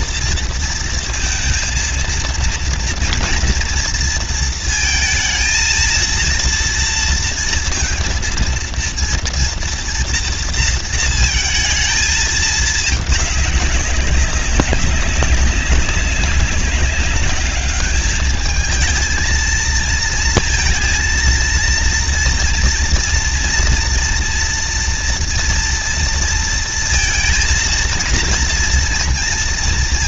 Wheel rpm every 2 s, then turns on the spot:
230, 230, 230, 230, 230, 230, 220, 190, 200, 220, 230, 230, 230, 230, 230.
none